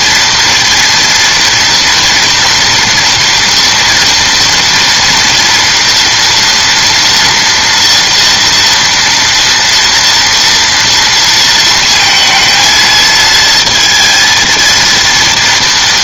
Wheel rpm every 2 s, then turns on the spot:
230, 230, 240, 240, 240, 230, 230, 230.
none